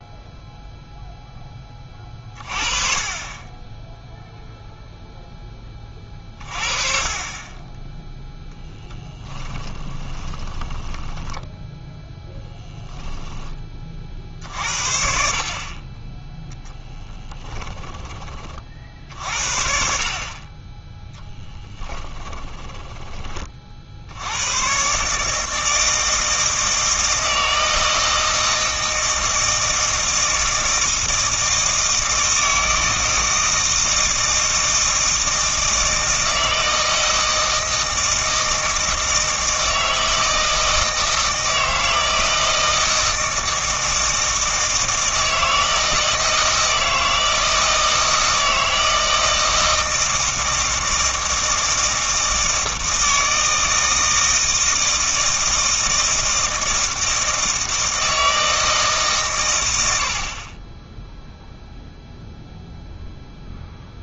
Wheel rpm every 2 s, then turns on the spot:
0, 30, 0, 30, 0, 10, 0, 60, 0, 50, 20, 10, 120, 160, 160, 160, 160, 160, 160, 160, 160, 160, 160, 160, 160, 160, 160, 160, 160, 150, 20, 0.
10-12